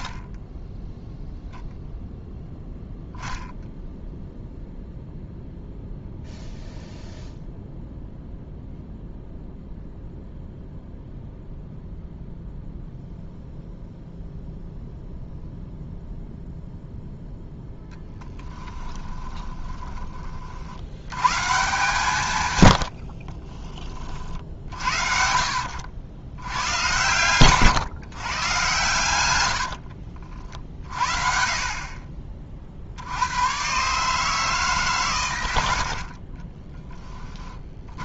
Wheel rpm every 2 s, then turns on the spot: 0, 10, 0, 0, 0, 0, 0, 0, 0, 20, 80, 80, 60, 100, 130, 50, 60, 140, 20.
18-20 22-24 36-38